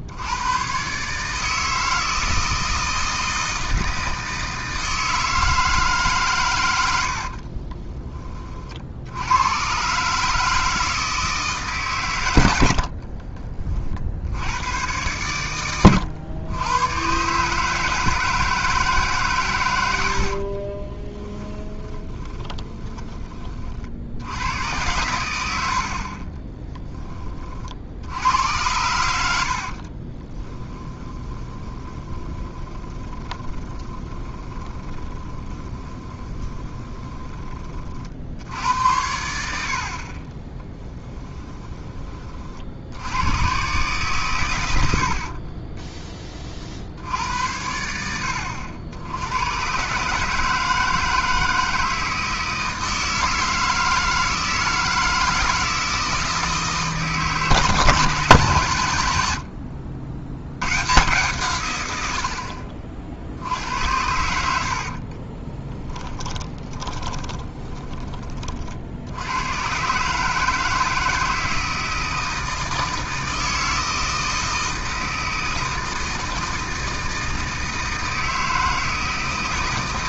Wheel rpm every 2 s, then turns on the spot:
110, 160, 160, 100, 50, 160, 60, 100, 100, 160, 40, 10, 100, 10, 90, 20, 20, 20, 20, 80, 20, 60, 100, 50, 80, 160, 160, 160, 160, 130, 110, 50, 80, 20, 50, 160, 160, 160, 160, 160.
20-24 30-38 40-42 64-68